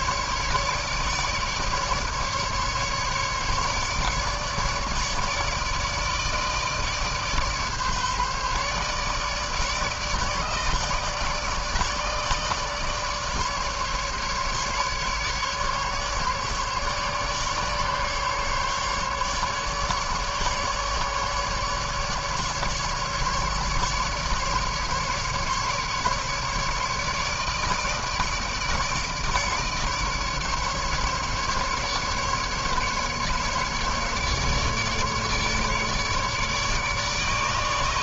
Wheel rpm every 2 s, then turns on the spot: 150, 150, 150, 150, 150, 150, 150, 150, 140, 150, 150, 150, 150, 150, 150, 150, 140, 150, 150.
none